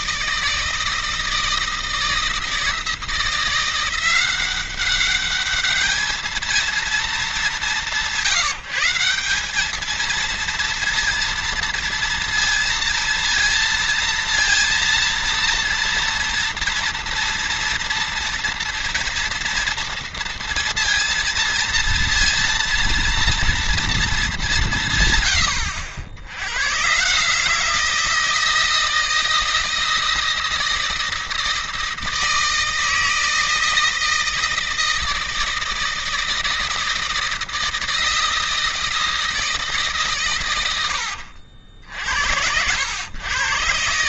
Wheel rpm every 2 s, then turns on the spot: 160, 160, 200, 220, 180, 230, 230, 230, 230, 230, 230, 230, 150, 130, 160, 160, 160, 160, 160, 160, 80, 90.
none